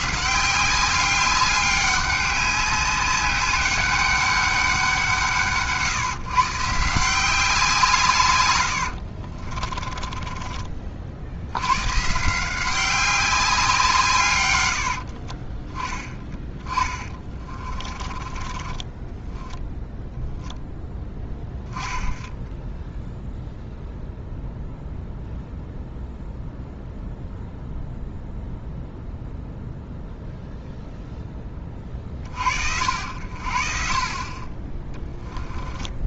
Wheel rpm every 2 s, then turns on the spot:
180, 200, 200, 150, 90, 30, 170, 110, 20, 20, 0, 0, 0, 0, 0, 0, 60, 30.
8-10 16-20